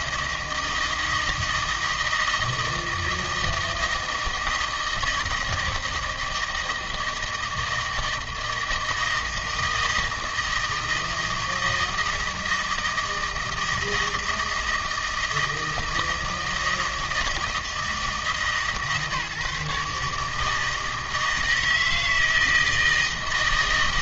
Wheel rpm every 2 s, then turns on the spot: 160, 160, 160, 160, 160, 160, 160, 160, 160, 150, 160, 160.
none